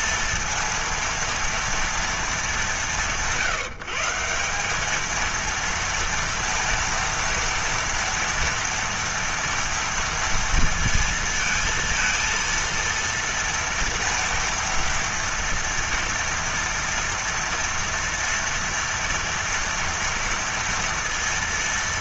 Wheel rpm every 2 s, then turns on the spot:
230, 190, 180, 230, 230, 230, 230, 230, 230, 230, 230.
none